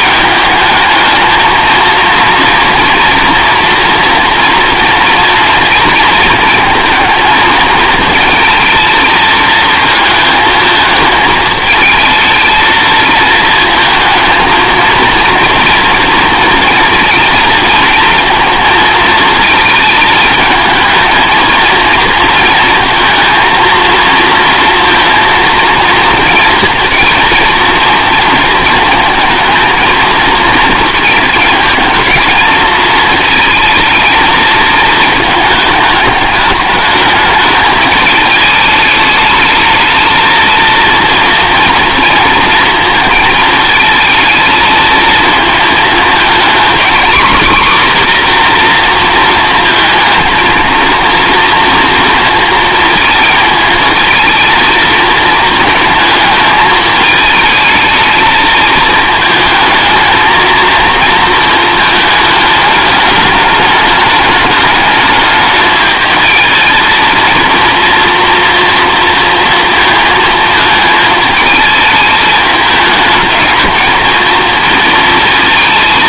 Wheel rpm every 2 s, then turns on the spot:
210, 240, 230, 220, 220, 220, 220, 230, 230, 230, 220, 230, 230, 230, 230, 220, 220, 220, 210, 210, 220, 230, 220, 250, 240, 230, 220, 230, 220, 220, 230, 210, 210, 230, 230, 220, 210, 230.
none